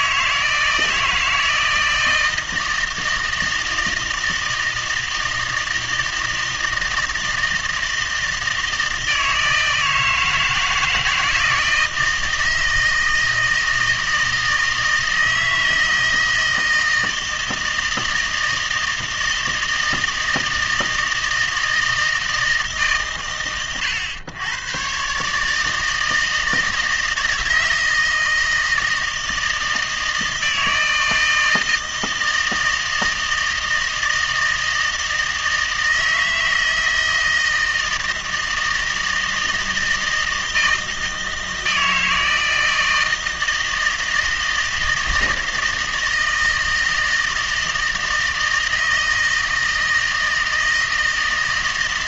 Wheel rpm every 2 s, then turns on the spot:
160, 160, 160, 160, 160, 160, 160, 160, 160, 160, 160, 150, 120, 160, 160, 160, 160, 160, 160, 160, 160, 160, 160, 160, 160, 160.
none